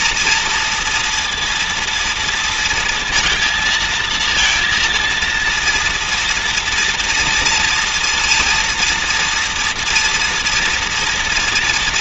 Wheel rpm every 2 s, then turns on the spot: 240, 230, 230, 230, 230, 240.
none